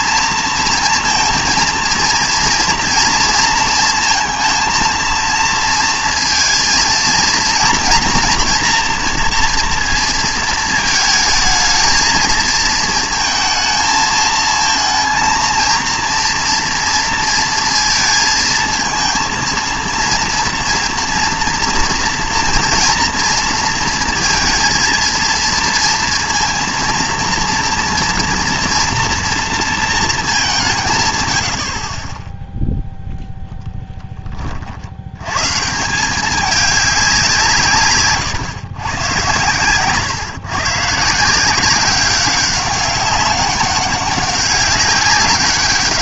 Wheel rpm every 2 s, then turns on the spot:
230, 230, 230, 230, 230, 220, 220, 220, 230, 230, 230, 230, 230, 230, 230, 170, 0, 50, 200, 120, 150, 200, 200.
none